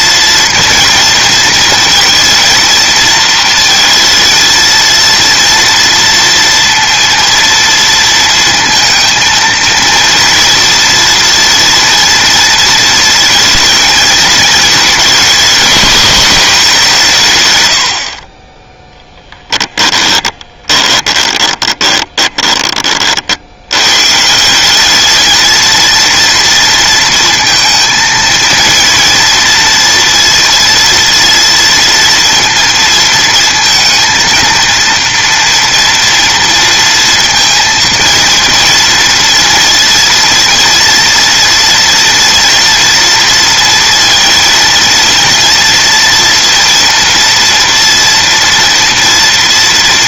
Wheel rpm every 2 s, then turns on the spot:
230, 230, 230, 230, 230, 230, 230, 220, 190, 10, 20, 30, 200, 230, 230, 230, 230, 230, 230, 230, 230, 230, 230, 230, 230.
20-22